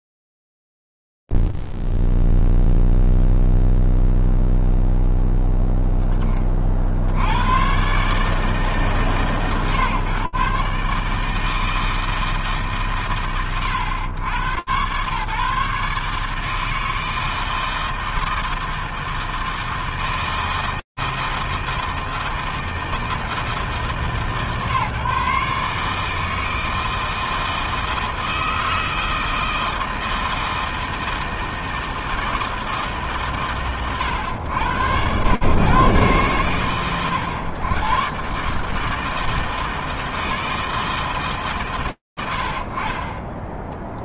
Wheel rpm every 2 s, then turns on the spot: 0, 0, 0, 30, 140, 140, 140, 100, 160, 160, 160, 160, 140, 160, 160, 160, 160, 110, 110, 130, 160, 50.
none